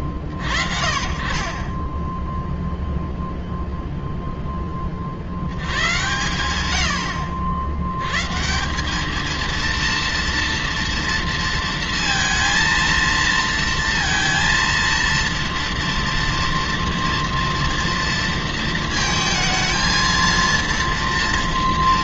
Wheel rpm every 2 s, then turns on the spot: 40, 0, 90, 110, 230, 230, 230, 230, 230, 230, 230.
none